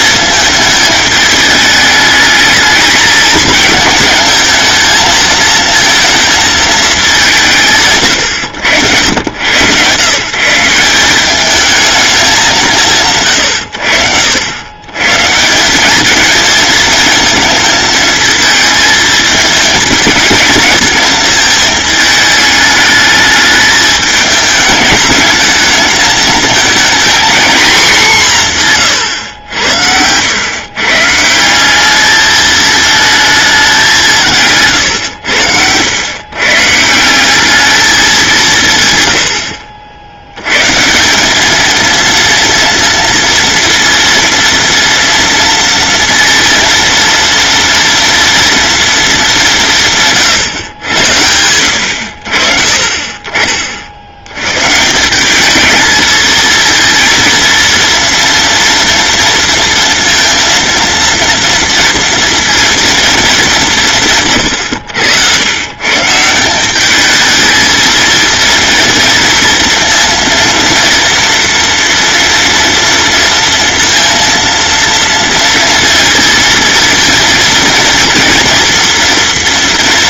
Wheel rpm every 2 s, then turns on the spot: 210, 220, 220, 200, 90, 190, 140, 130, 220, 220, 220, 210, 210, 230, 140, 140, 220, 110, 160, 130, 160, 230, 230, 230, 230, 90, 40, 150, 230, 230, 230, 230, 100, 200, 230, 230, 230, 230, 230, 230.
28-30